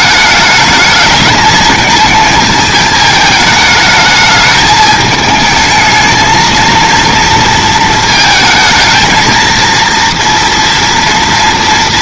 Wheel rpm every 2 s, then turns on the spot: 210, 220, 210, 220, 230, 230.
none